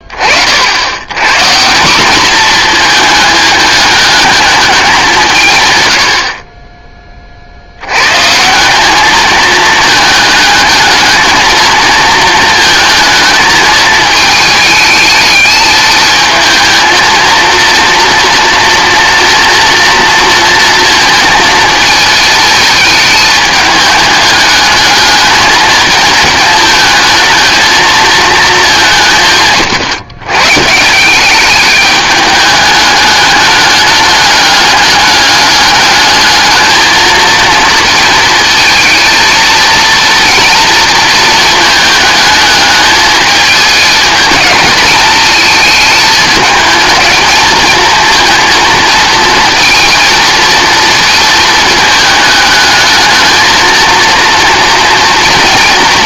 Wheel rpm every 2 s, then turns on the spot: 60, 220, 210, 40, 170, 220, 230, 220, 230, 230, 230, 220, 220, 220, 210, 150, 210, 210, 220, 220, 230, 220, 220, 220, 230, 230, 220, 230.
none